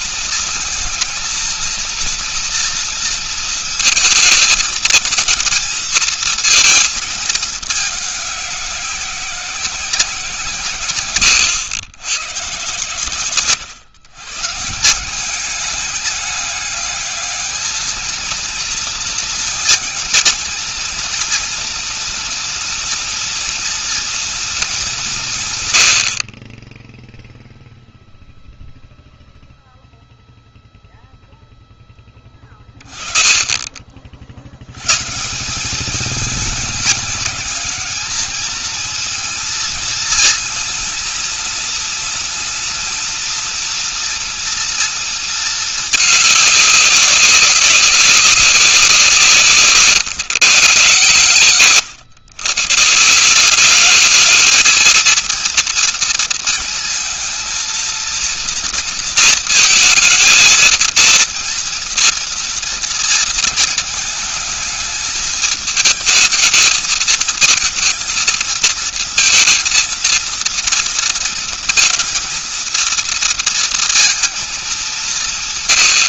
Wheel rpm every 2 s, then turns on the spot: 220, 230, 220, 220, 190, 120, 140, 170, 210, 220, 230, 230, 200, 10, 0, 0, 30, 120, 210, 220, 230, 230, 230, 200, 180, 130, 160, 230, 230, 230, 230, 230, 220, 220, 220, 230, 230, 190.
10-12